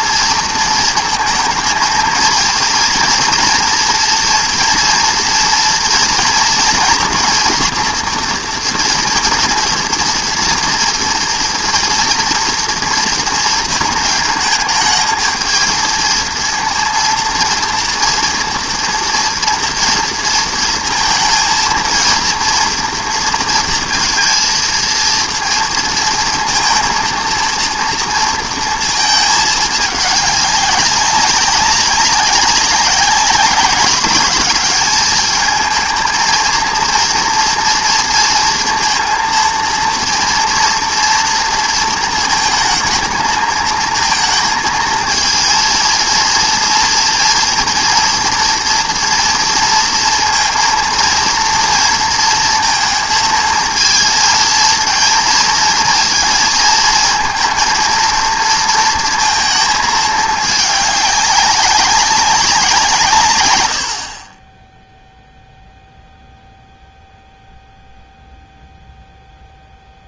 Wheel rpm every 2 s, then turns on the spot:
230, 230, 230, 230, 240, 230, 240, 220, 230, 230, 230, 230, 230, 230, 230, 210, 190, 190, 230, 240, 230, 230, 220, 230, 230, 230, 230, 230, 230, 230, 220, 200, 30, 0, 0.
none